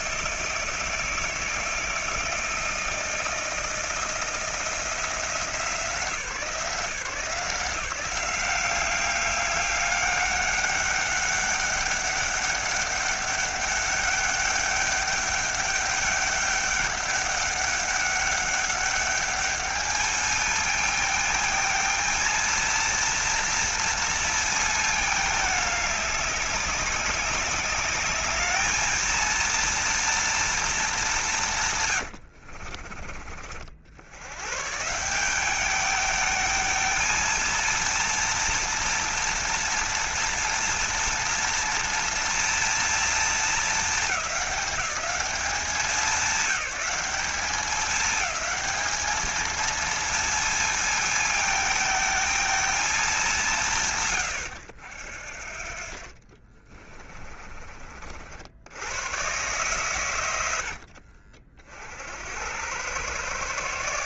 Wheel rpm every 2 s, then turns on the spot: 160, 160, 170, 170, 190, 200, 200, 200, 200, 200, 220, 230, 220, 200, 220, 220, 60, 130, 220, 230, 230, 230, 210, 200, 220, 220, 220, 90, 30, 80, 70, 90.
32-34 56-58